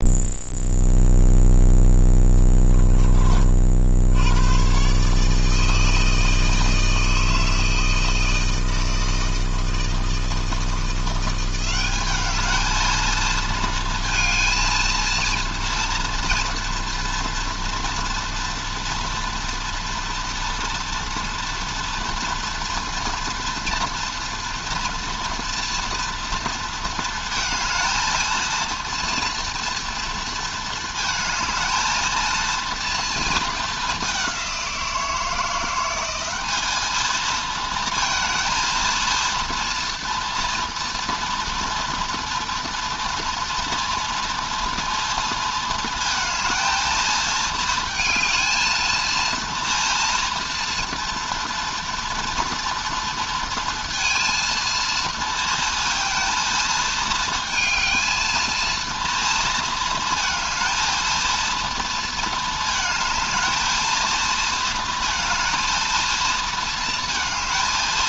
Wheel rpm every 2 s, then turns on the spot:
0, 20, 130, 160, 160, 170, 220, 230, 230, 240, 230, 230, 240, 230, 230, 220, 230, 180, 220, 230, 230, 230, 230, 220, 230, 240, 230, 220, 220, 230, 230, 220, 220, 230.
none